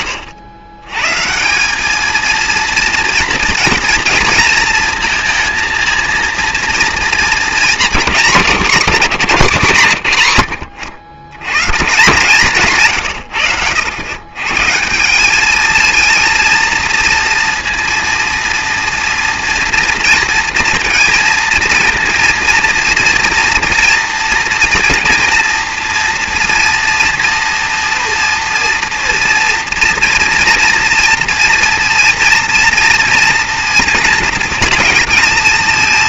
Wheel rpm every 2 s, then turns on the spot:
120, 230, 230, 230, 180, 100, 160, 140, 230, 230, 230, 230, 230, 230, 240, 240, 230, 230.
none